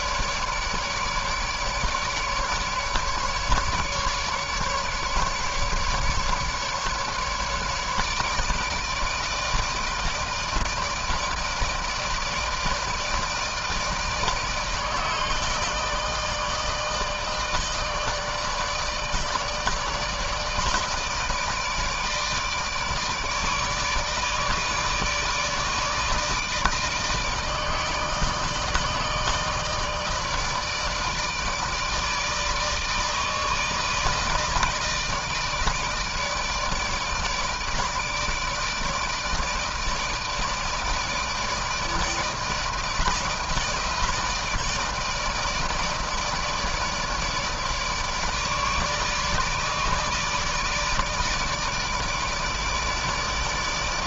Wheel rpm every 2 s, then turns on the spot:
150, 150, 150, 150, 150, 160, 160, 160, 160, 160, 160, 150, 150, 160, 160, 160, 160, 160, 150, 150, 160, 160, 160, 150, 150, 160, 150.
none